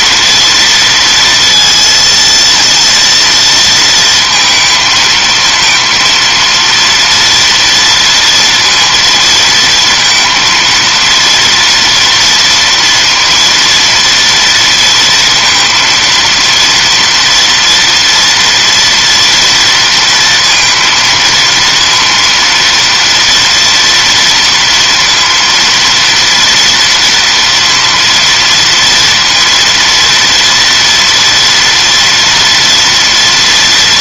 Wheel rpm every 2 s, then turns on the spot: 230, 230, 220, 230, 230, 230, 230, 230, 230, 230, 230, 230, 230, 230, 230, 230, 230.
none